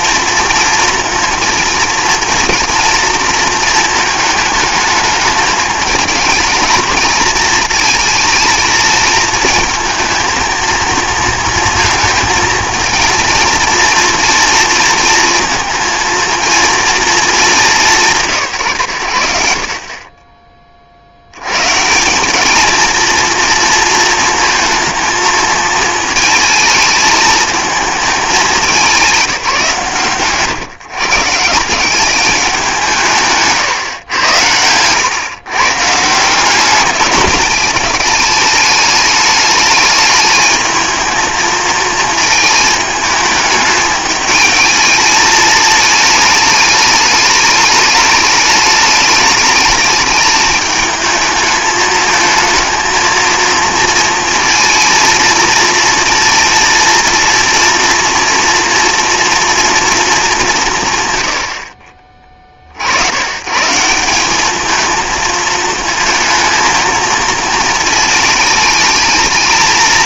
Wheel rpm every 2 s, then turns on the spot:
230, 230, 220, 220, 220, 230, 230, 230, 230, 130, 40, 210, 220, 220, 200, 130, 180, 100, 190, 210, 220, 220, 220, 210, 210, 220, 220, 230, 230, 230, 170, 60, 220, 220, 210.
none